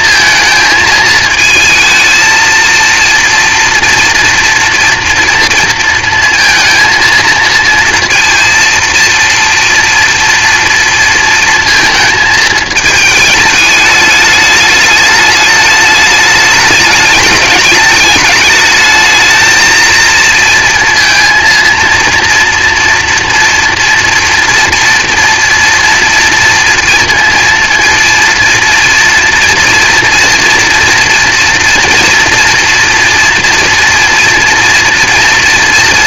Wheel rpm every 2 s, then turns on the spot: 220, 230, 230, 230, 230, 240, 220, 220, 210, 210, 230, 230, 230, 230, 230, 230, 230, 230.
none